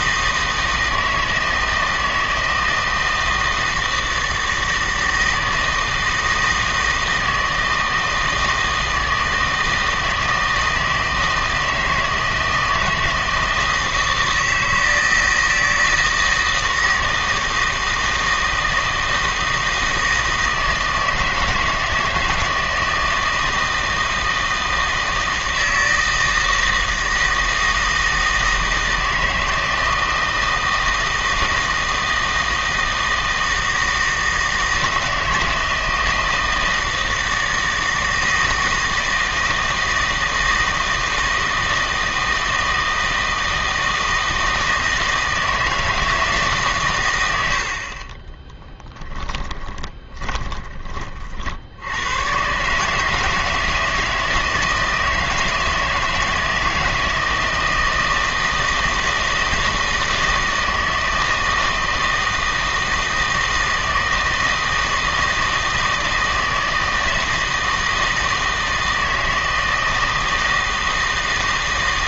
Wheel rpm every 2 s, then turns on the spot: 160, 160, 160, 160, 160, 160, 160, 160, 160, 160, 160, 160, 160, 160, 160, 160, 160, 160, 160, 160, 160, 160, 160, 140, 20, 30, 140, 160, 160, 160, 160, 160, 160, 160, 160, 160.
48-50